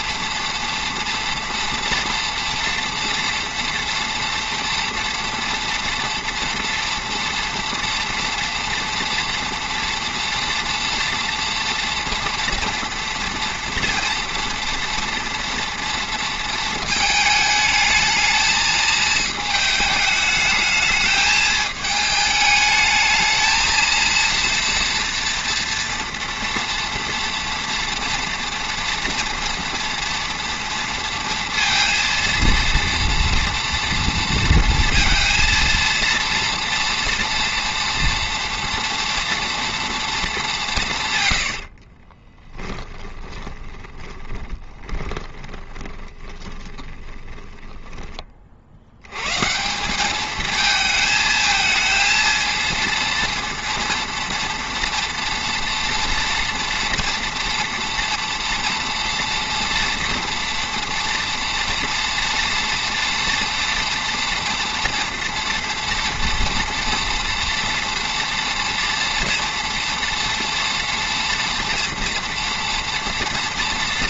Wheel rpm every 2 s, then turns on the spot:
230, 230, 230, 240, 230, 230, 230, 230, 230, 220, 210, 220, 230, 230, 230, 230, 230, 230, 230, 230, 210, 20, 20, 20, 30, 220, 230, 230, 230, 230, 240, 240, 230, 230, 230, 240, 230.
42-48